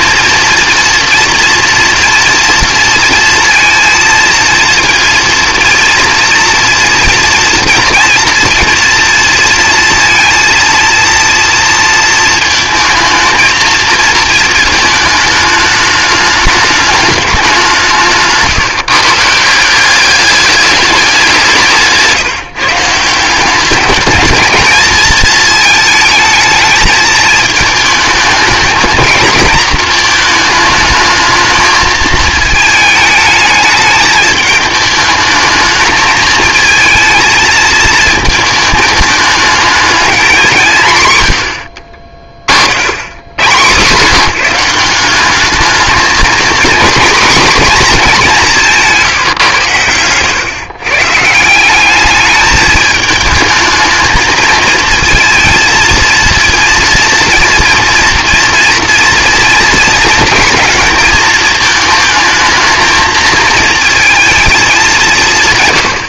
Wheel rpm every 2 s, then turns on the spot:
230, 230, 230, 230, 230, 230, 220, 220, 210, 150, 200, 150, 220, 220, 220, 220, 220, 210, 230, 220, 160, 60, 170, 240, 180, 130, 220, 220, 230, 230, 220, 220, 210.
none